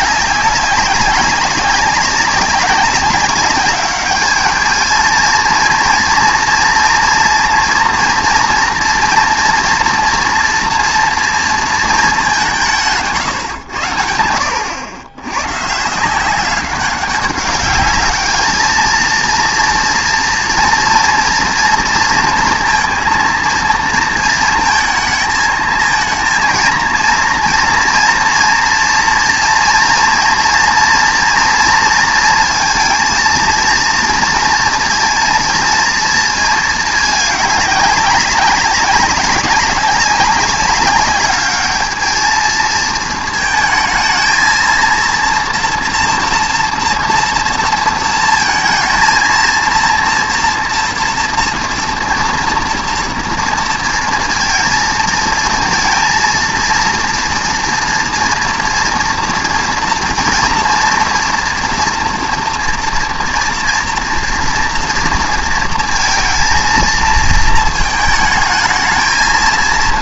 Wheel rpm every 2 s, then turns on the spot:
190, 190, 210, 230, 230, 230, 180, 100, 190, 220, 230, 230, 230, 230, 230, 230, 230, 230, 220, 190, 200, 220, 230, 230, 230, 230, 230, 220, 230, 230, 230, 240, 240, 230, 220.
none